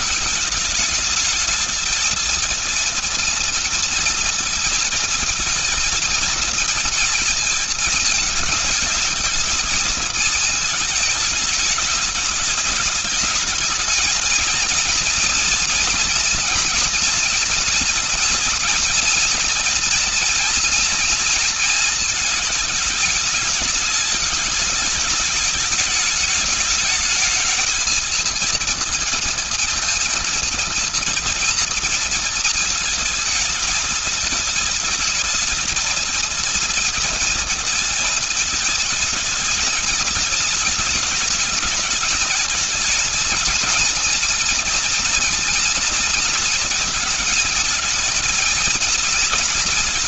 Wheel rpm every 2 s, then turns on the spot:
210, 220, 230, 230, 220, 220, 210, 220, 230, 230, 230, 220, 210, 210, 220, 220, 220, 220, 230, 220, 220, 220, 230, 230, 230.
none